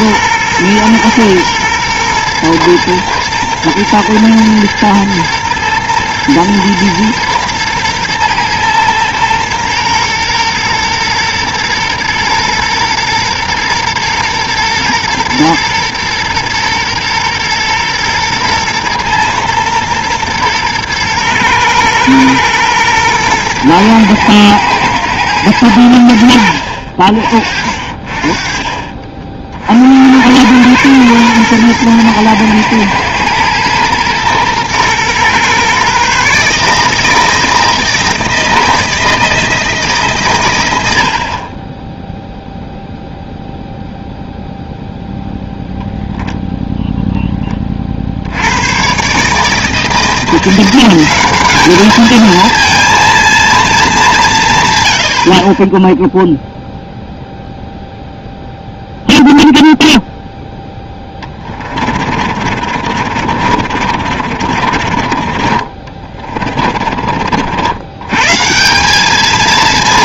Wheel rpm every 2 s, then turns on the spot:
120, 120, 120, 120, 120, 120, 120, 120, 120, 120, 120, 120, 110, 60, 30, 110, 110, 120, 150, 160, 100, 0, 0, 0, 100, 180, 230, 140, 0, 0, 0, 50, 40, 40, 160.
62-68